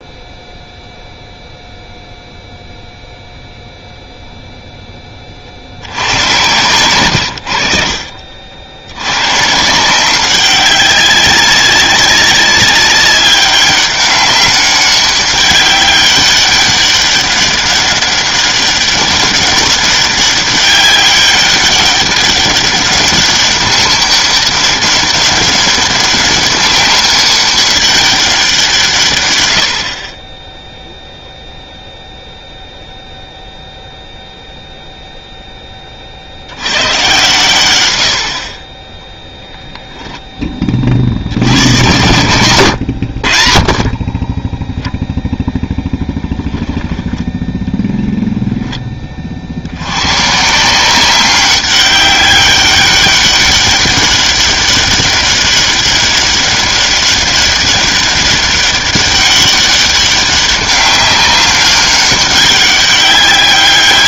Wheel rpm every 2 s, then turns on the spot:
0, 0, 0, 110, 70, 190, 190, 190, 200, 200, 200, 200, 200, 190, 180, 10, 0, 0, 90, 40, 20, 100, 10, 10, 10, 160, 200, 200, 200, 200, 200, 200.
6-8 46-48